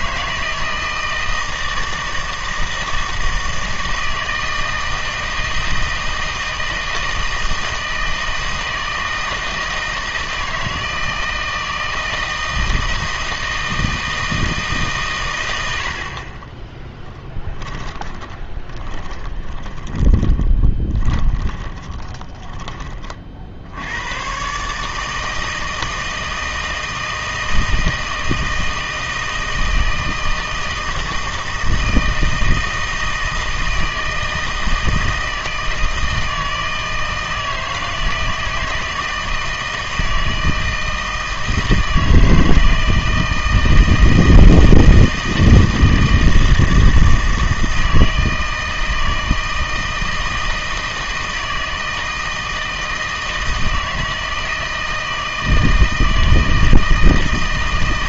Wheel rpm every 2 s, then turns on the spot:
160, 160, 160, 160, 160, 160, 160, 150, 20, 20, 10, 20, 140, 160, 160, 160, 160, 160, 160, 160, 160, 160, 160, 160, 160, 160, 160, 160, 160.
16-22